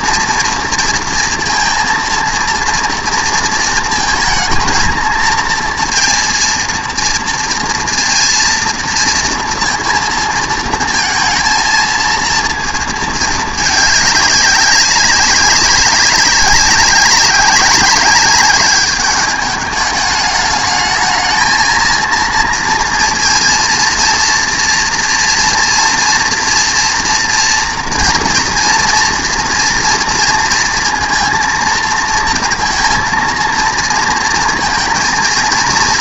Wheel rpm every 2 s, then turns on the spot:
230, 230, 230, 230, 230, 230, 230, 200, 200, 200, 220, 230, 230, 230, 240, 230, 230, 230.
none